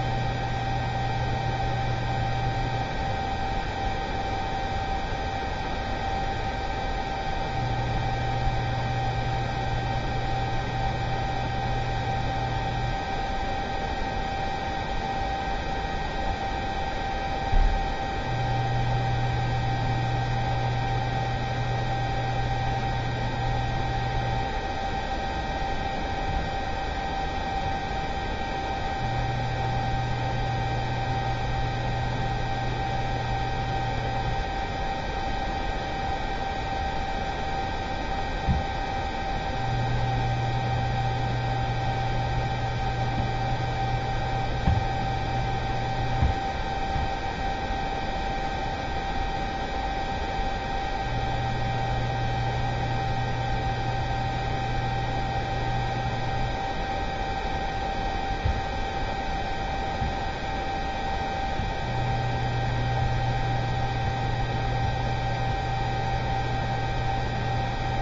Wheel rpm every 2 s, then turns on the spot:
0, 0, 0, 0, 0, 0, 0, 0, 0, 0, 0, 0, 0, 0, 0, 0, 0, 0, 0, 0, 0, 0, 0, 0, 0, 0, 0, 0, 0, 0, 0, 0, 0, 0.
none